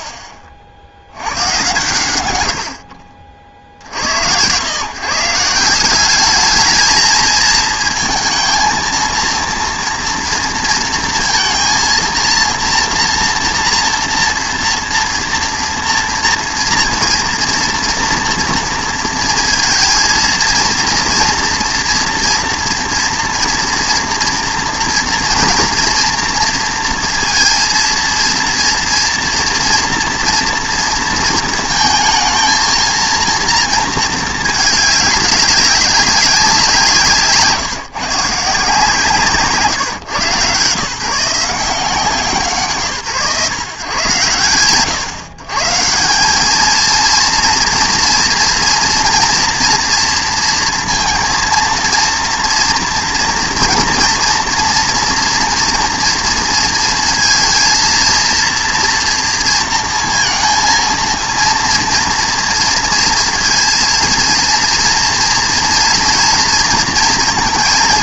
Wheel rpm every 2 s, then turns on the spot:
40, 100, 120, 210, 230, 230, 230, 230, 230, 230, 230, 230, 230, 230, 230, 230, 220, 210, 180, 160, 140, 180, 110, 220, 230, 230, 230, 240, 230, 230, 230, 230, 230, 230.
none